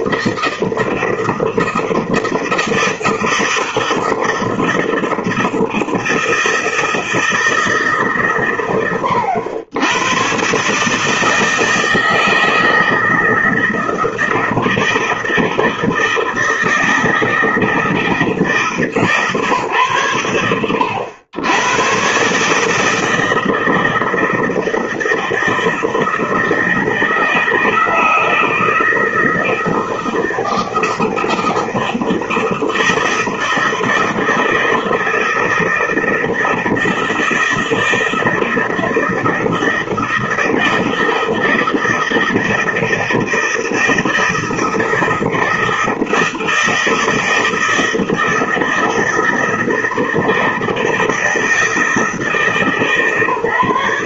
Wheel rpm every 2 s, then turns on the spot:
160, 160, 160, 160, 120, 130, 160, 160, 160, 160, 100, 150, 160, 160, 160, 160, 160, 160, 160, 160, 160, 160, 160, 160, 160, 160, 150.
none